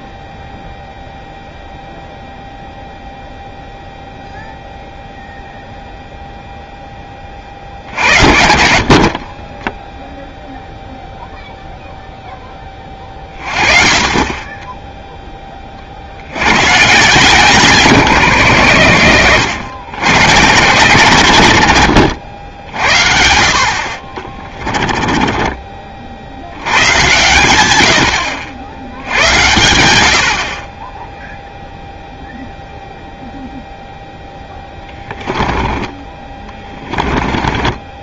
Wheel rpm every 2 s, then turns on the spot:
0, 0, 0, 0, 50, 0, 20, 10, 120, 120, 140, 70, 20, 100, 70, 30, 0, 10, 20.
24-26 34-38